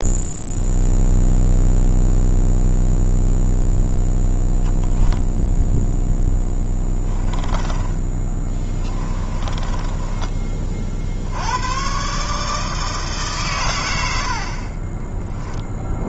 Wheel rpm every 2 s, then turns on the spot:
0, 0, 0, 10, 20, 30, 160, 20.
6-10 14-16